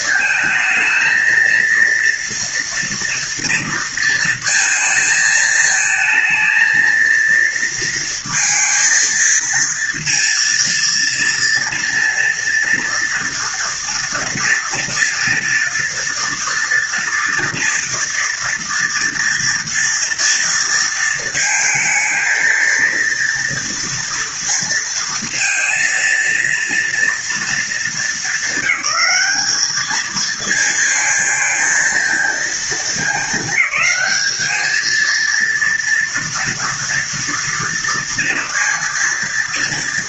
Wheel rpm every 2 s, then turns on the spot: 220, 230, 230, 220, 230, 230, 230, 230, 230, 230, 230, 230, 230, 230, 220, 220, 230, 220, 230, 230.
none